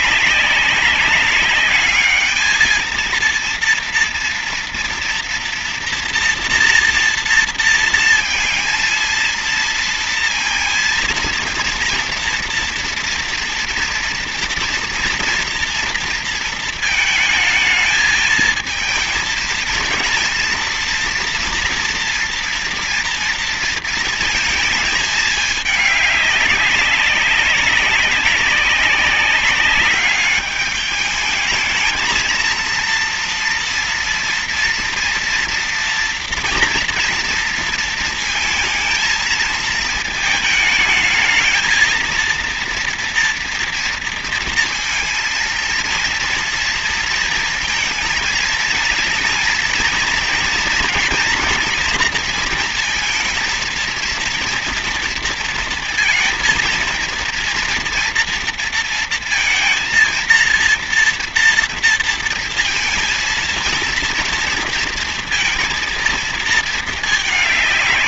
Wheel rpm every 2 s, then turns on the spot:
200, 220, 230, 230, 230, 230, 230, 230, 230, 220, 230, 230, 220, 200, 190, 210, 230, 240, 230, 230, 220, 230, 230, 230, 230, 230, 230, 230, 230, 230, 230, 230, 230, 220.
none